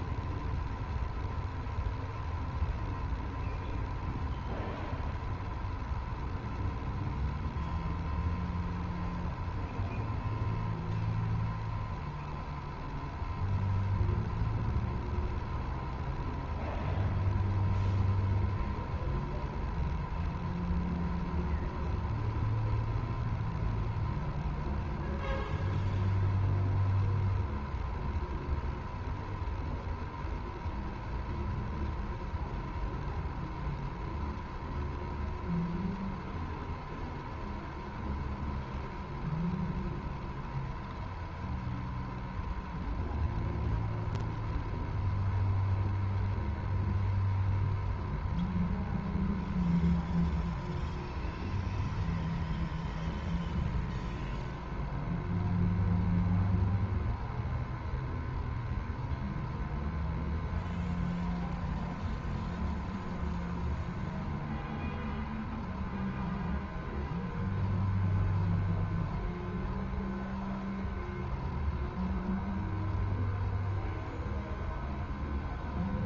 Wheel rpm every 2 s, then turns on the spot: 0, 0, 0, 0, 0, 0, 0, 0, 0, 0, 0, 0, 0, 0, 0, 0, 0, 0, 0, 0, 0, 0, 0, 0, 0, 0, 0, 0, 0, 0, 0, 0, 0, 0, 0, 0, 0, 0.
none